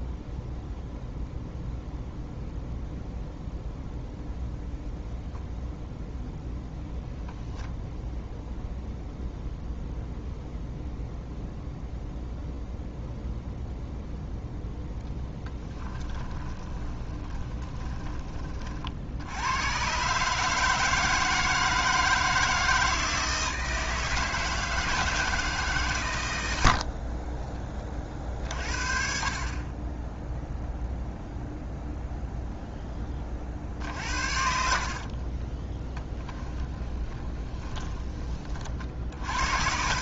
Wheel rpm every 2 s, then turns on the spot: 0, 0, 0, 0, 0, 0, 0, 10, 20, 60, 160, 160, 160, 60, 50, 0, 10, 40, 20, 50.
16-18 34-38